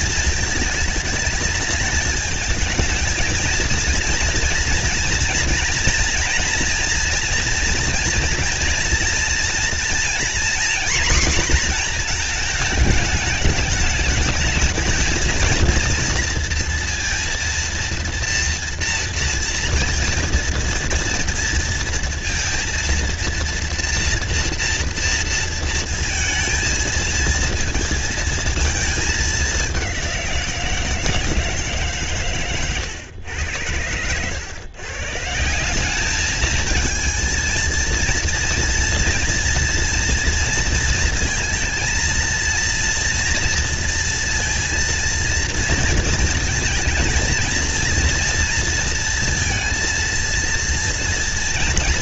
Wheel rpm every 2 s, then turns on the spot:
220, 220, 230, 230, 230, 250, 220, 220, 230, 230, 230, 230, 240, 230, 220, 170, 110, 110, 220, 230, 230, 230, 230, 230, 230, 230.
none